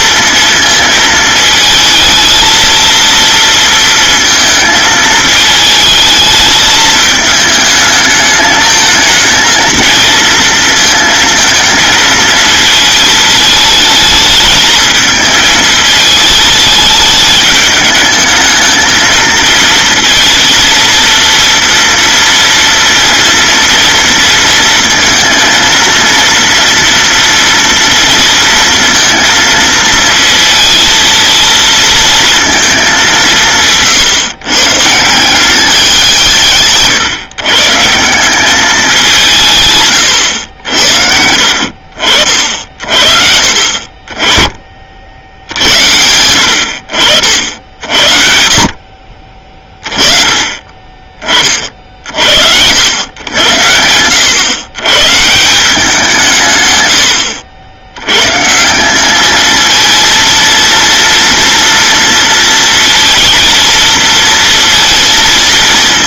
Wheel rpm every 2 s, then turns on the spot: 230, 230, 220, 220, 220, 230, 220, 220, 210, 220, 230, 230, 230, 230, 230, 230, 220, 130, 150, 200, 80, 50, 30, 80, 50, 20, 80, 120, 120, 170, 230, 230, 230.
none